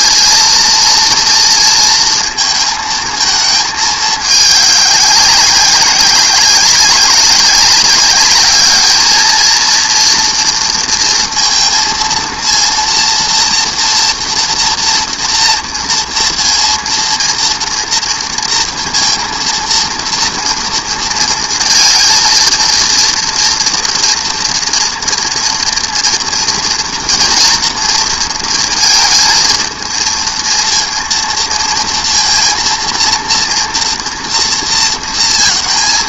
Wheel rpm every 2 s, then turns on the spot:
230, 230, 200, 190, 210, 230, 230, 230, 230, 230, 230, 230, 230, 230, 230, 230, 230, 230.
none